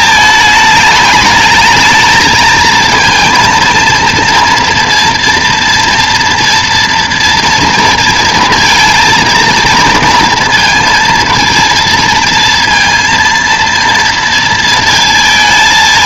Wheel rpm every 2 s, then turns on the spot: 210, 220, 230, 230, 230, 230, 230, 230.
none